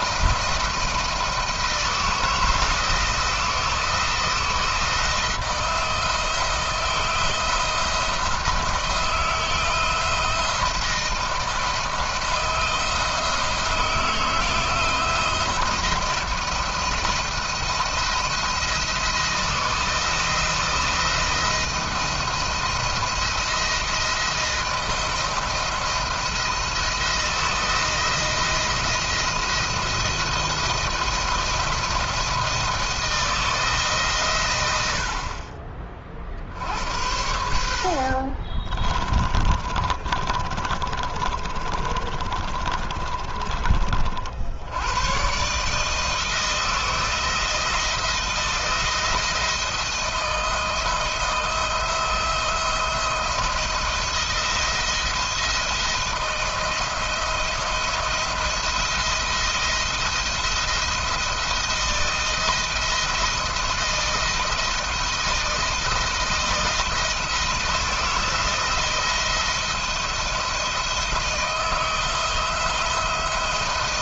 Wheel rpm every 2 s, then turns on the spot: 170, 160, 170, 160, 170, 170, 170, 160, 170, 170, 160, 170, 160, 170, 170, 170, 170, 80, 70, 40, 30, 30, 90, 170, 170, 160, 170, 170, 170, 170, 170, 170, 170, 160, 170, 160, 170.
38-44